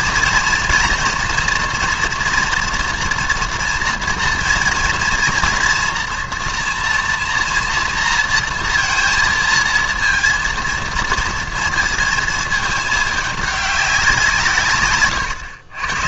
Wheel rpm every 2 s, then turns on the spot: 230, 230, 230, 240, 230, 230, 220, 140.
none